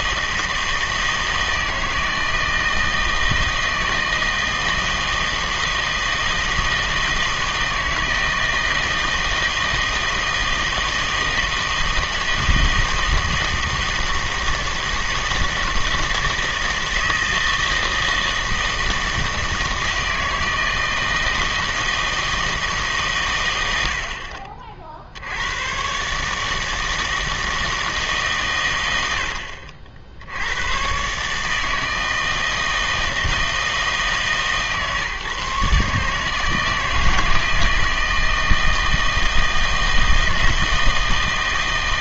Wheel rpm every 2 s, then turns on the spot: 160, 160, 160, 160, 160, 160, 160, 160, 160, 160, 160, 150, 40, 160, 120, 100, 160, 150, 160, 160, 160.
none